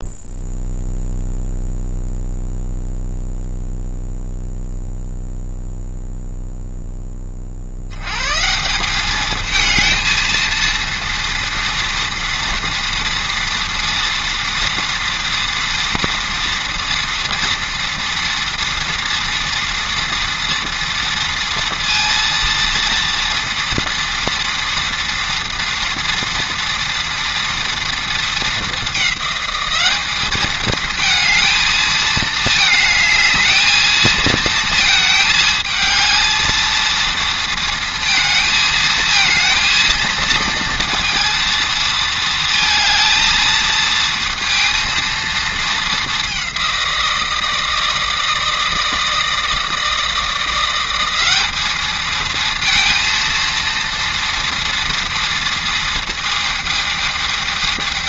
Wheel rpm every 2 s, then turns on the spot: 0, 0, 0, 20, 210, 230, 230, 230, 230, 230, 230, 230, 230, 230, 200, 220, 220, 220, 230, 220, 230, 220, 230, 180, 160, 190, 230, 230, 220.
none